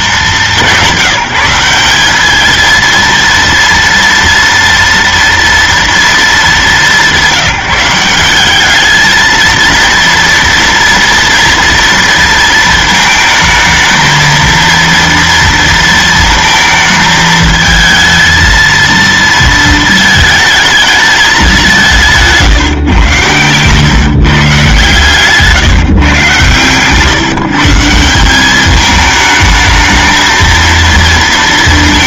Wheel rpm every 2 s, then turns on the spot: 190, 220, 230, 190, 200, 230, 230, 230, 220, 230, 220, 150, 140, 130, 200, 230.
26-28